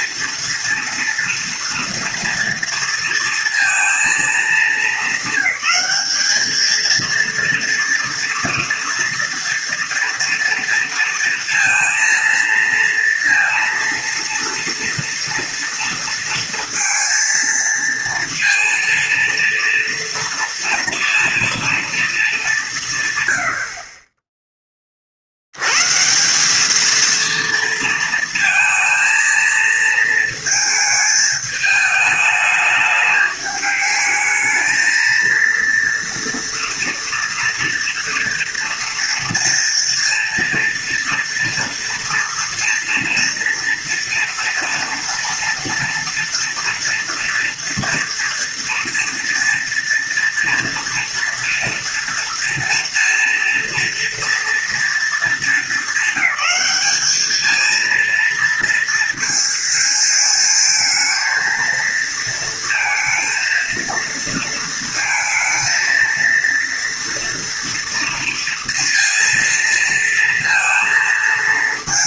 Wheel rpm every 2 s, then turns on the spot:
230, 230, 210, 220, 240, 230, 230, 230, 230, 230, 230, 180, 10, 200, 230, 220, 210, 220, 230, 230, 230, 230, 230, 230, 230, 230, 230, 230, 210, 230, 220, 230, 230, 230, 230, 230.
none